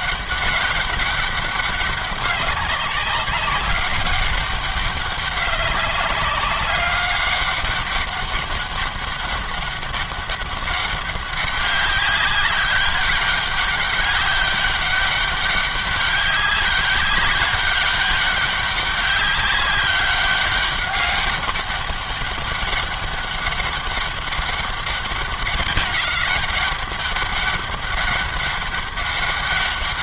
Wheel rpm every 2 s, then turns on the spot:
200, 190, 200, 200, 200, 200, 190, 200, 200, 200, 200, 200, 200, 200, 200.
none